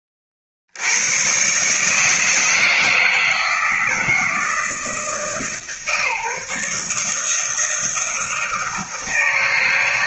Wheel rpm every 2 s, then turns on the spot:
90, 160, 160, 150, 160.
none